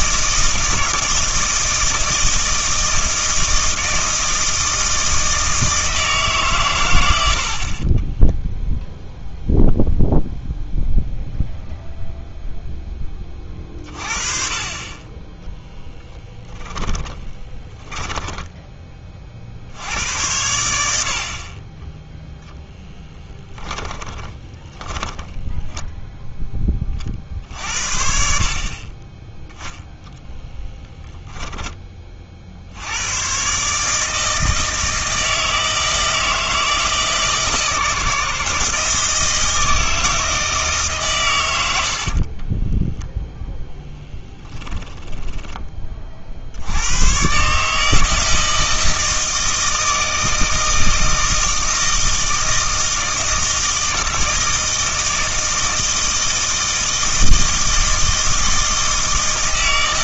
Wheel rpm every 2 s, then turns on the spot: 160, 160, 160, 120, 0, 0, 0, 30, 10, 10, 80, 0, 20, 20, 40, 10, 70, 160, 160, 160, 150, 20, 10, 80, 160, 160, 160, 160, 160, 160.
16-18 24-26 30-32 42-46